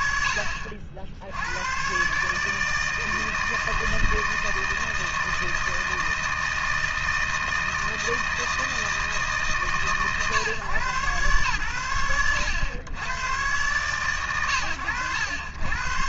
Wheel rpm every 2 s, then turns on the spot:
80, 160, 160, 160, 140, 110, 100, 90.
none